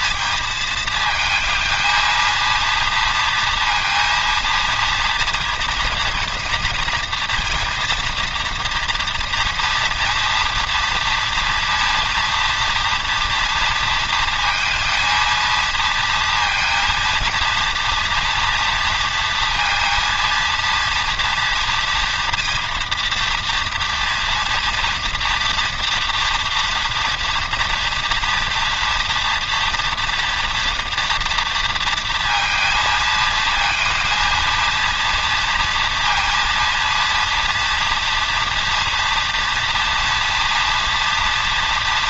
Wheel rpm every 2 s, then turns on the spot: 220, 230, 230, 230, 240, 230, 240, 230, 230, 230, 230, 230, 240, 230, 230, 230, 220, 230, 230, 240, 230.
none